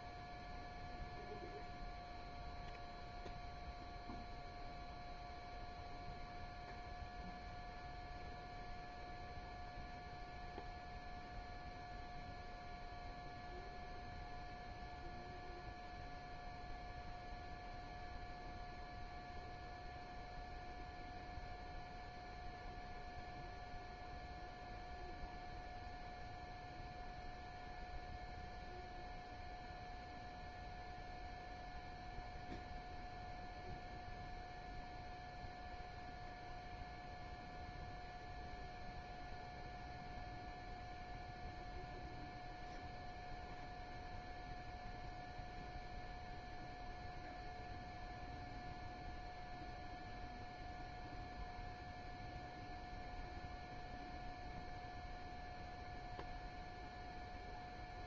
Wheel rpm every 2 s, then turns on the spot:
0, 0, 0, 0, 0, 0, 0, 0, 0, 0, 0, 0, 0, 0, 0, 0, 0, 0, 0, 0, 0, 0, 0, 0, 0, 0, 0, 0, 0.
none